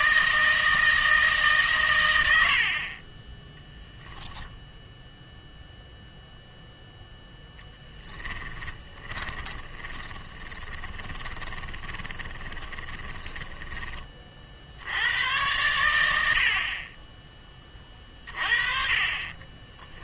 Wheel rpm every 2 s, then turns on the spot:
160, 50, 0, 0, 20, 10, 20, 70, 40, 40.
2-4 8-14